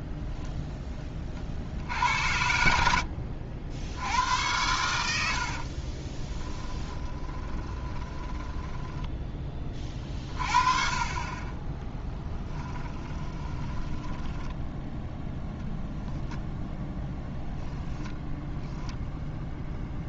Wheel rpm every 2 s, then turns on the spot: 10, 80, 90, 20, 10, 40, 20, 10, 0, 0.
2-4 6-10 12-16